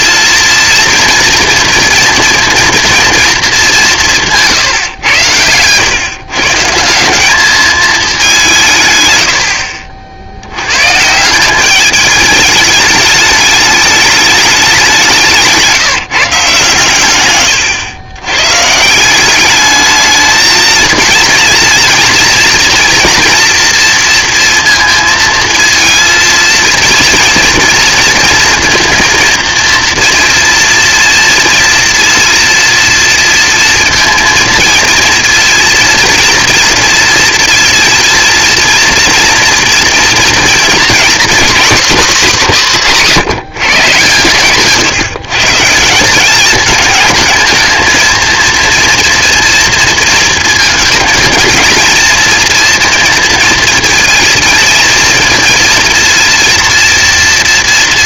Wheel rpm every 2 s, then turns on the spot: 230, 230, 150, 160, 170, 100, 210, 200, 130, 130, 220, 230, 230, 230, 230, 230, 230, 230, 230, 230, 230, 230, 150, 210, 230, 220, 230, 230, 230.
none